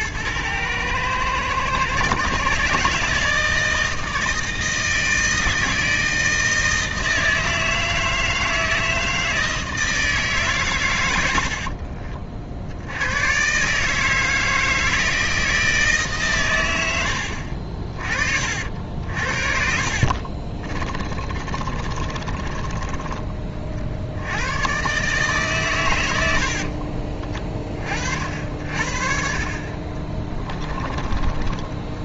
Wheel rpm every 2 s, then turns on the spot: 110, 150, 160, 160, 160, 130, 80, 160, 90, 60, 30, 20, 130, 50, 60, 20.
18-24 26-28 30-32